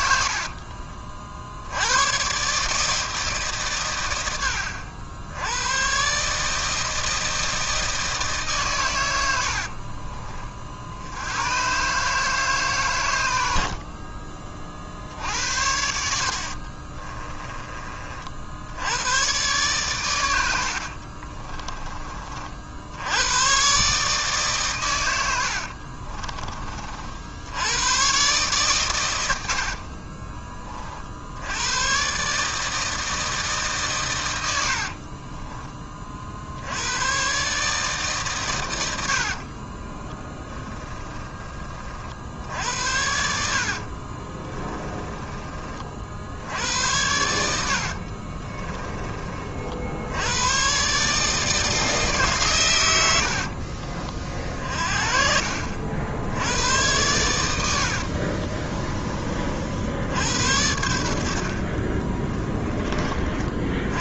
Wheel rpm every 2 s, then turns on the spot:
50, 150, 80, 160, 110, 70, 110, 60, 30, 100, 60, 90, 110, 50, 110, 50, 160, 50, 110, 90, 10, 70, 20, 90, 20, 140, 100, 40, 100, 30, 70, 30.
16-18 20-22 34-36 40-42 44-46